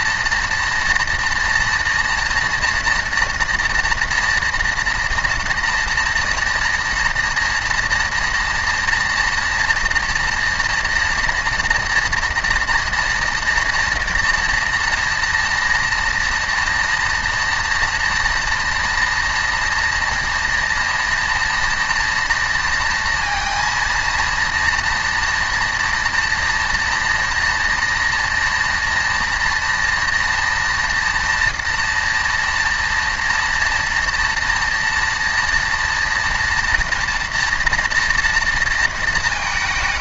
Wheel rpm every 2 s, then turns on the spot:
230, 230, 240, 240, 230, 230, 230, 230, 230, 230, 230, 230, 230, 240, 230, 230, 230, 230, 230, 230.
none